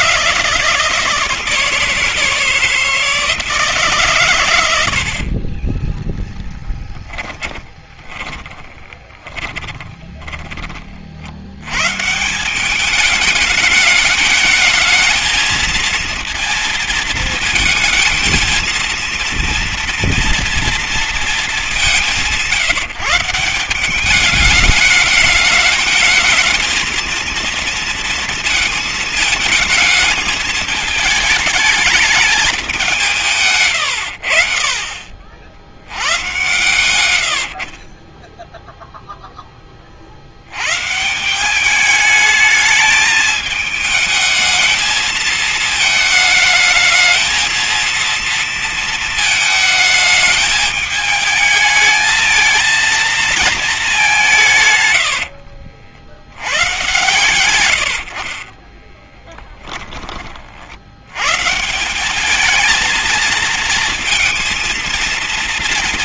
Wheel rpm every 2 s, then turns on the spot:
160, 160, 120, 10, 20, 20, 170, 220, 230, 230, 230, 170, 200, 220, 230, 220, 210, 60, 120, 10, 100, 220, 220, 210, 230, 210, 220, 160, 100, 40, 50, 210, 230.
6-10 58-60